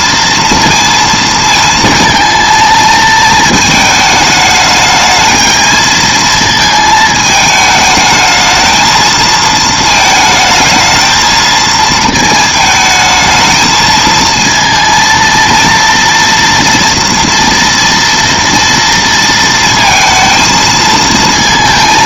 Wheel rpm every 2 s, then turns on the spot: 230, 220, 210, 220, 220, 220, 220, 230, 230, 230, 220.
none